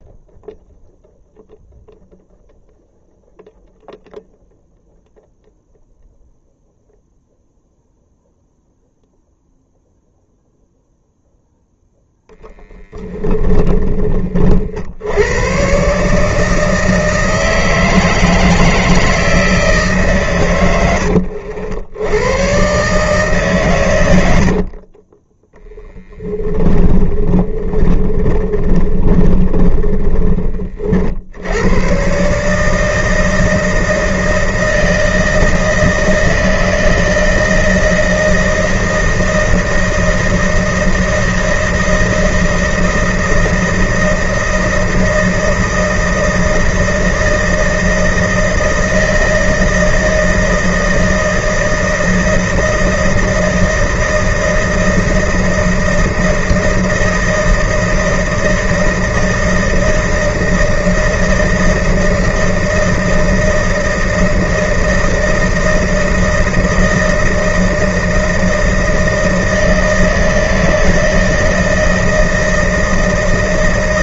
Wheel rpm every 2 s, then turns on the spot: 0, 0, 0, 0, 0, 0, 10, 80, 160, 160, 90, 140, 30, 20, 20, 70, 160, 160, 160, 160, 160, 160, 160, 160, 160, 160, 160, 160, 160, 160, 160, 160, 160, 160, 160, 160, 160.
12-14 24-30